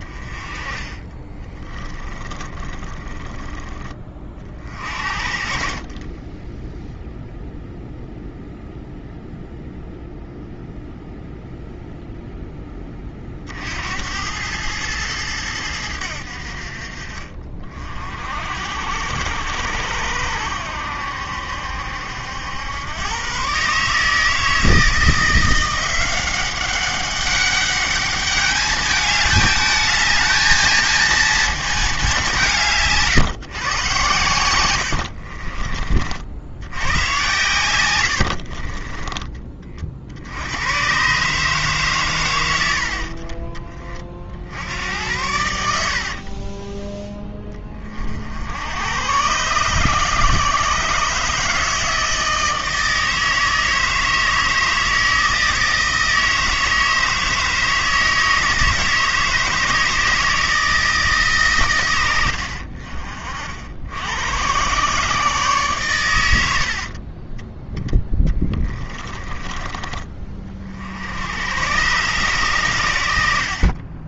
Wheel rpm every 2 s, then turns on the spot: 20, 20, 40, 0, 0, 0, 10, 110, 50, 70, 80, 100, 160, 190, 210, 230, 160, 90, 100, 30, 110, 80, 80, 20, 100, 150, 160, 160, 160, 150, 160, 50, 120, 60, 20, 60, 100.
0-4 32-36 38-40